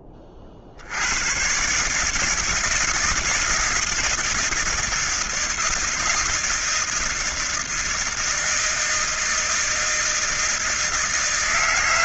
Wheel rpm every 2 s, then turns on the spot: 50, 160, 160, 160, 160, 170.
none